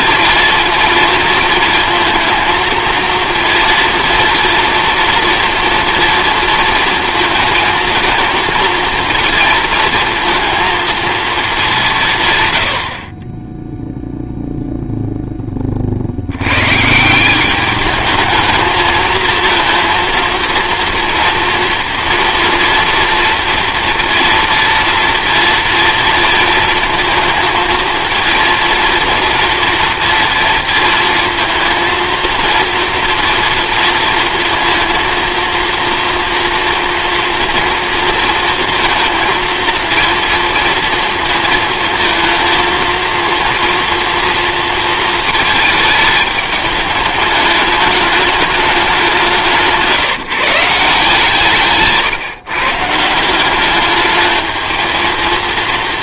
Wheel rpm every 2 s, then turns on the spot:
230, 230, 230, 230, 230, 220, 80, 0, 130, 220, 240, 230, 230, 230, 230, 230, 230, 230, 230, 230, 230, 230, 230, 210, 200, 160, 140, 220.
none